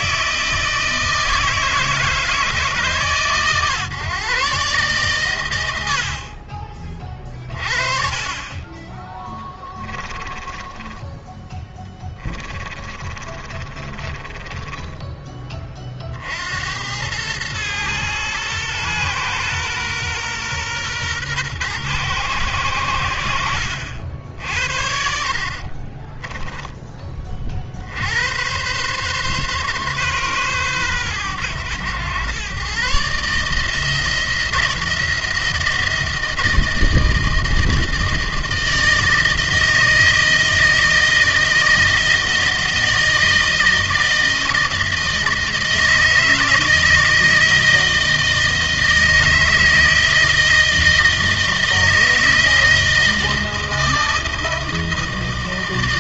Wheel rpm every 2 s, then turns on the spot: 160, 150, 130, 30, 20, 10, 20, 20, 80, 120, 120, 100, 70, 20, 120, 120, 140, 170, 160, 160, 160, 160, 160, 160, 160, 160, 160, 160.
12-16